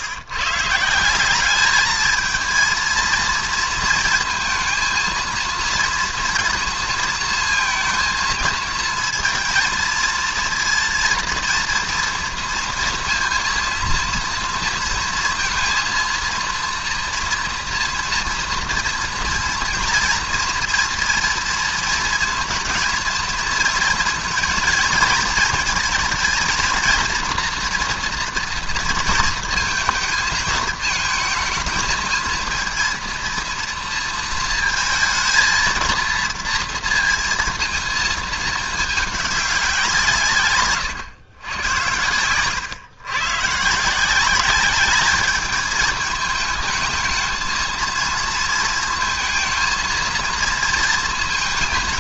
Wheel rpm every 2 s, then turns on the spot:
150, 230, 230, 230, 230, 230, 230, 230, 230, 230, 230, 230, 230, 220, 230, 220, 230, 220, 230, 210, 140, 120, 200, 220, 220, 230.
40-42